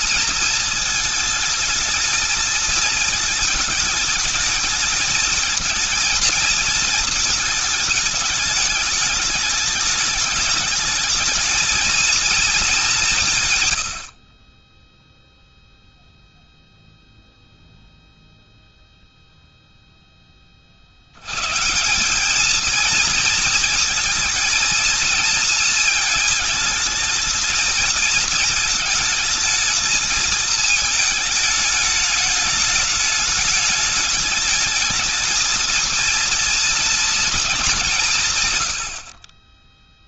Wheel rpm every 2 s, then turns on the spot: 220, 220, 220, 220, 220, 220, 210, 30, 0, 0, 50, 220, 230, 220, 220, 220, 210, 220, 230, 110.
none